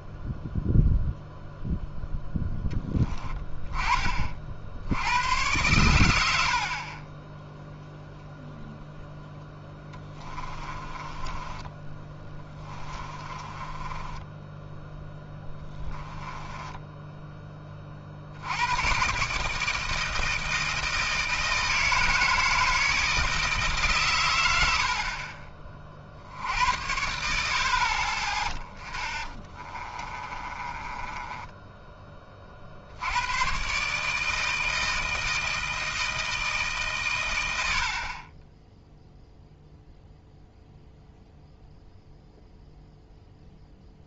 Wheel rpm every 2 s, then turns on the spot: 0, 10, 60, 50, 0, 20, 20, 10, 10, 100, 160, 160, 70, 80, 10, 20, 40, 160, 150, 10, 0, 0.
6-8 10-18 30-32 38-40